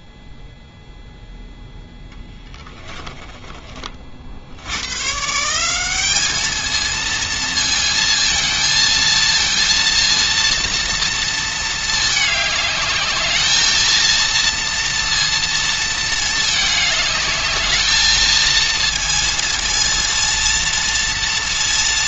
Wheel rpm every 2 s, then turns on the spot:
0, 10, 80, 220, 230, 230, 210, 230, 210, 230, 230.
2-4